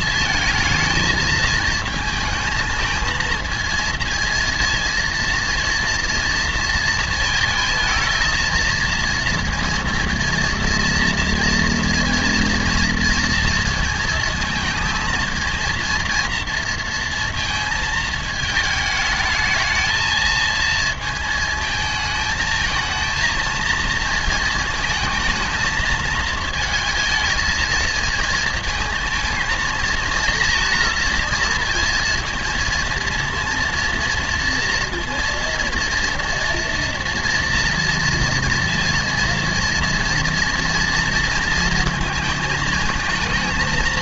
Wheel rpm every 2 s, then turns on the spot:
220, 220, 230, 230, 230, 230, 230, 230, 230, 220, 220, 220, 220, 220, 230, 230, 230, 230, 230, 230, 230, 220.
none